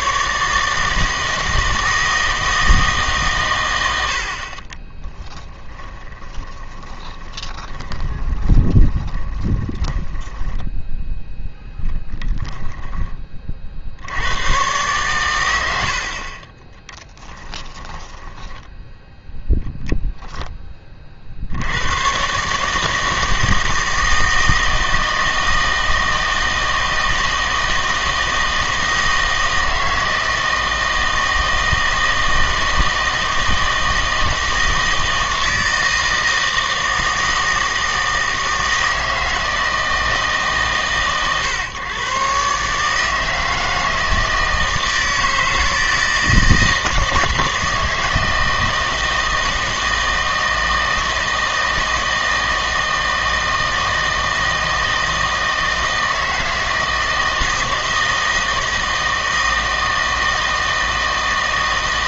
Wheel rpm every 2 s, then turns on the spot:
160, 160, 20, 20, 20, 10, 10, 130, 10, 10, 20, 150, 160, 160, 160, 160, 160, 160, 160, 160, 130, 150, 160, 160, 160, 160, 160, 160, 160, 160, 160.
4-14 18-20